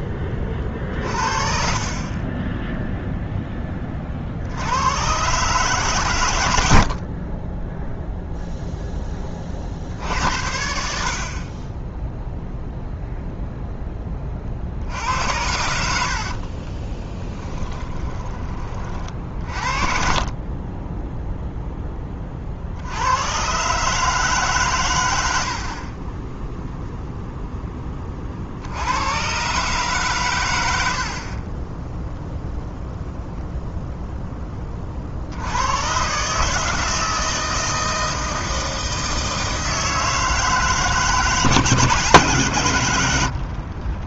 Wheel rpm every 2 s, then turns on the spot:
40, 0, 90, 70, 10, 70, 0, 70, 20, 30, 10, 60, 100, 0, 90, 70, 0, 30, 160, 160, 160, 100.
16-18 30-32 42-44